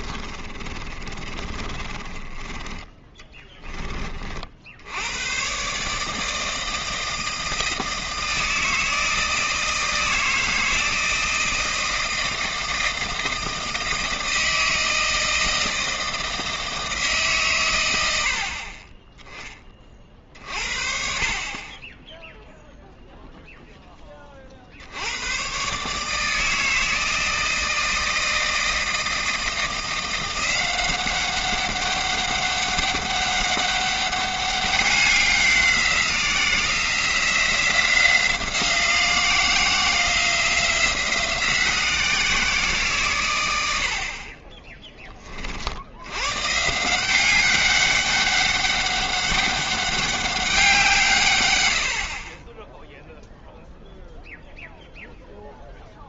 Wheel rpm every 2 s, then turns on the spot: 30, 20, 60, 160, 160, 160, 160, 160, 160, 40, 50, 0, 50, 160, 160, 180, 200, 200, 170, 170, 170, 160, 30, 140, 200, 180, 10, 0.
0-2